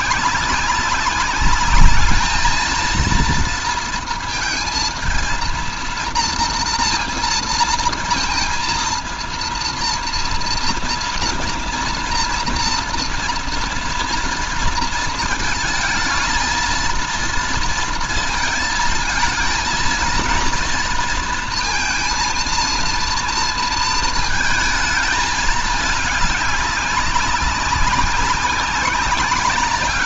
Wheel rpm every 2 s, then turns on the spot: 200, 220, 230, 230, 230, 230, 230, 230, 230, 230, 230, 230, 220, 200, 190.
none